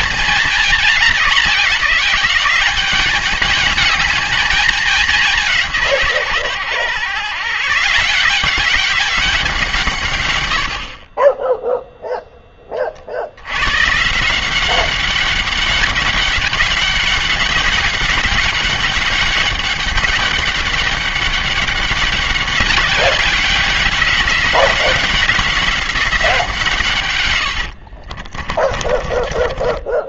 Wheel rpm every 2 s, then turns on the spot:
210, 200, 210, 120, 190, 80, 20, 180, 200, 200, 200, 190, 180, 140, 30.
28-30